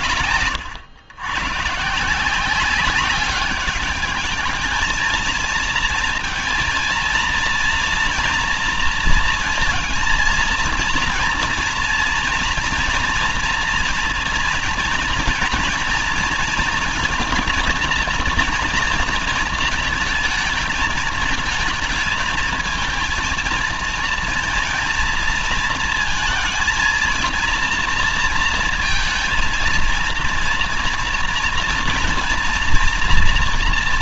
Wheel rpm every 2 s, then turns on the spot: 130, 190, 220, 220, 230, 230, 230, 230, 230, 230, 220, 220, 230, 230, 230, 230, 230.
0-2